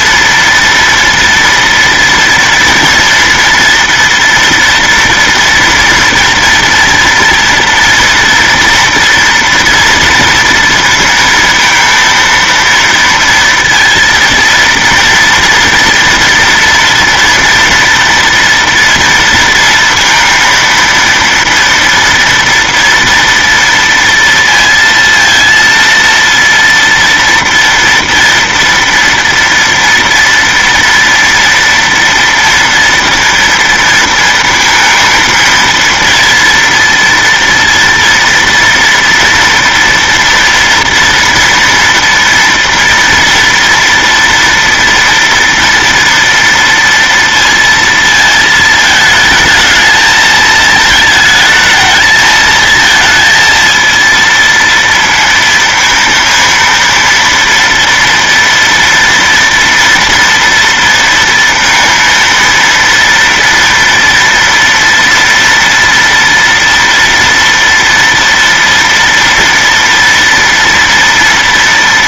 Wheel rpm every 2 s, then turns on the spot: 240, 240, 230, 230, 240, 230, 230, 230, 230, 230, 230, 230, 230, 230, 230, 230, 230, 220, 230, 230, 230, 230, 230, 230, 220, 220, 220, 230, 230, 230, 230, 230, 230, 230, 230, 230.
none